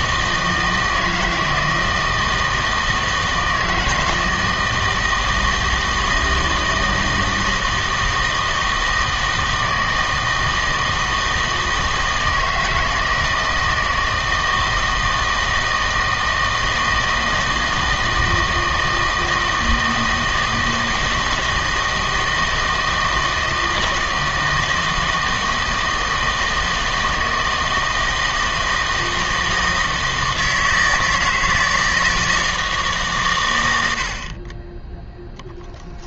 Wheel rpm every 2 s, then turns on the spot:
160, 160, 160, 160, 160, 160, 160, 160, 160, 160, 160, 160, 160, 160, 160, 160, 160, 20.
none